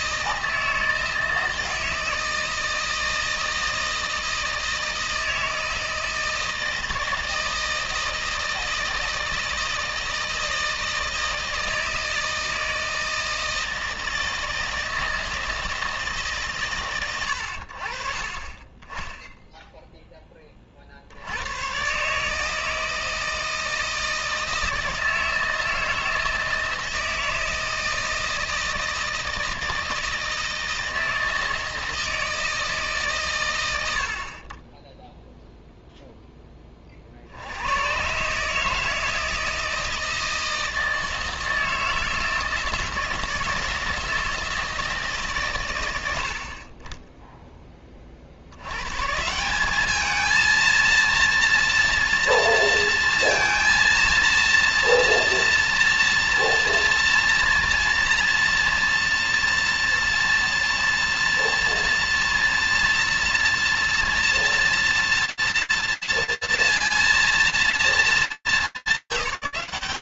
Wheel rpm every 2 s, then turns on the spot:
160, 160, 160, 160, 160, 160, 160, 160, 140, 40, 20, 150, 160, 160, 160, 160, 160, 40, 10, 140, 160, 160, 160, 50, 60, 220, 230, 230, 230, 230, 230, 230, 230, 230, 180.
none